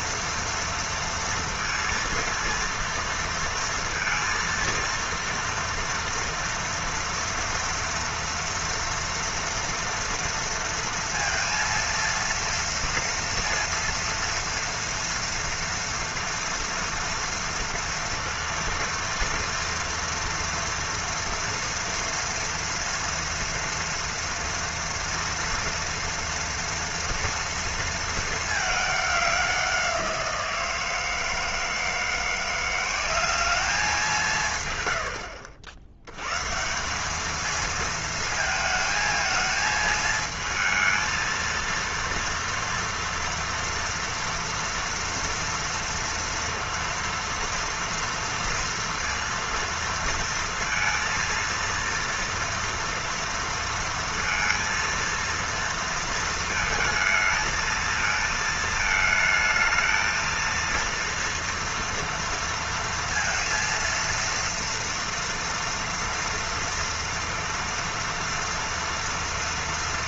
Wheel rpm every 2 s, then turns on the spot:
230, 230, 230, 230, 230, 230, 230, 230, 230, 230, 230, 230, 230, 230, 220, 170, 170, 170, 120, 220, 220, 230, 230, 230, 230, 230, 230, 230, 220, 220, 230, 230, 230, 230, 240.
none